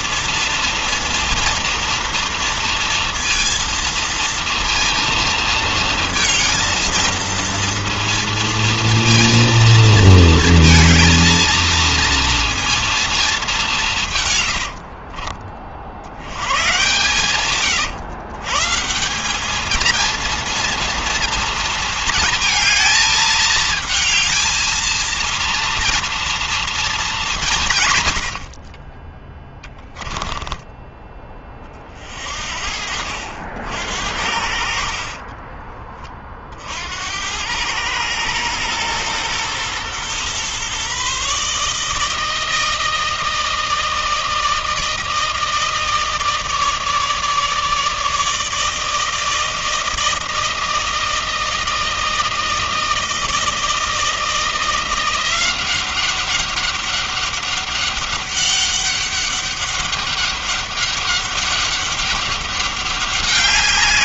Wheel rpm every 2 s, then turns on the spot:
230, 230, 230, 230, 230, 230, 220, 40, 120, 170, 230, 220, 230, 200, 30, 20, 60, 50, 80, 120, 140, 160, 160, 160, 160, 160, 160, 180, 200, 200, 200, 200.
14-16 34-36